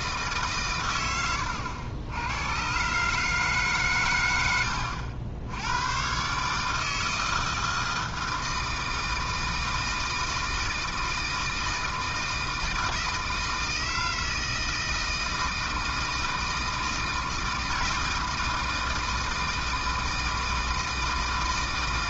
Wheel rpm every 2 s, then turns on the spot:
120, 120, 90, 150, 160, 160, 160, 160, 160, 160, 160.
none